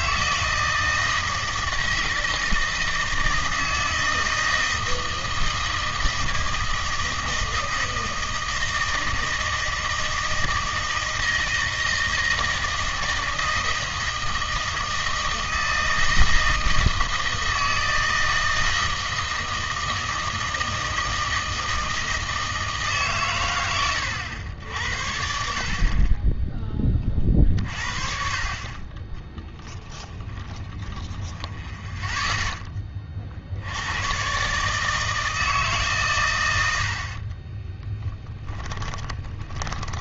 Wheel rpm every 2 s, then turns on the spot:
160, 160, 160, 160, 160, 160, 160, 160, 160, 160, 160, 160, 80, 20, 30, 10, 10, 140, 90, 20.
30-32 38-40